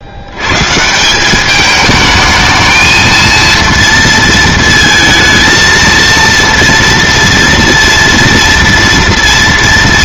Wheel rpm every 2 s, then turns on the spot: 170, 230, 230, 230, 230.
none